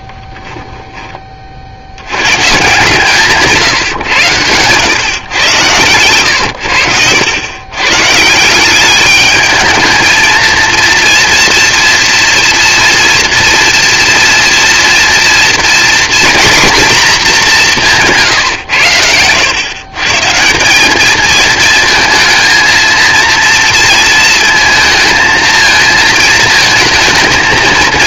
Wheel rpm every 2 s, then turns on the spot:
20, 140, 130, 90, 200, 230, 230, 230, 230, 100, 200, 230, 230, 220.
none